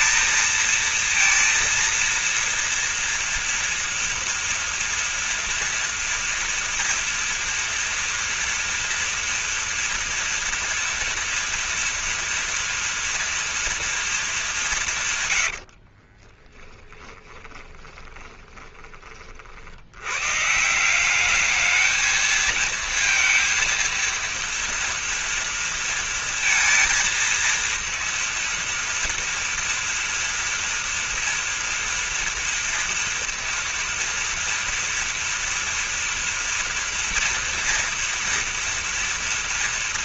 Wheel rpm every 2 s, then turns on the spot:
230, 230, 230, 230, 240, 230, 230, 190, 10, 20, 170, 230, 230, 230, 230, 230, 230, 230, 230, 230.
16-18